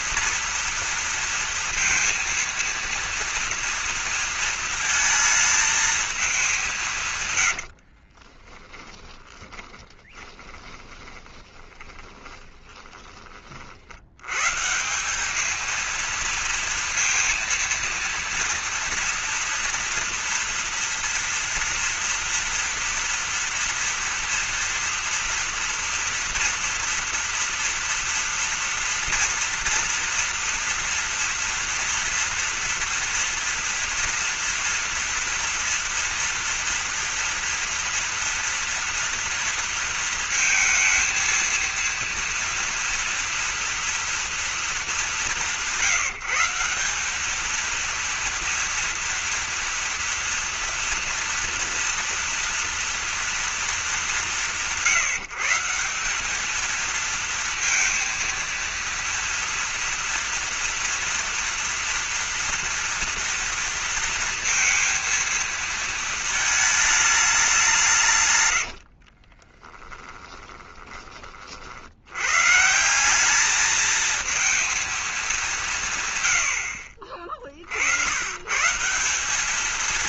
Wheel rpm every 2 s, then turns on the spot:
230, 230, 230, 180, 20, 20, 20, 150, 230, 230, 230, 230, 230, 230, 230, 230, 230, 230, 230, 230, 230, 240, 220, 180, 230, 240, 230, 140, 220, 230, 240, 230, 230, 220, 100, 20, 150, 230, 70, 150.
8-14 68-72